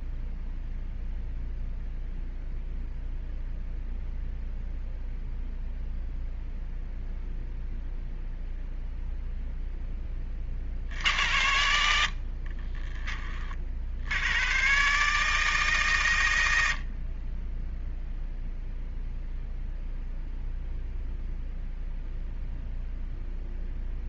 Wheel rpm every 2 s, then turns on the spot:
0, 0, 0, 0, 0, 80, 20, 140, 50, 0, 0, 0.
none